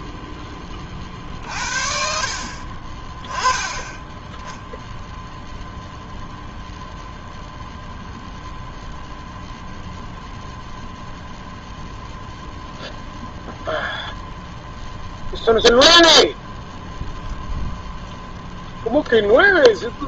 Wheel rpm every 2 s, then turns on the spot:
30, 30, 0, 0, 0, 0, 0, 0, 0, 0.
none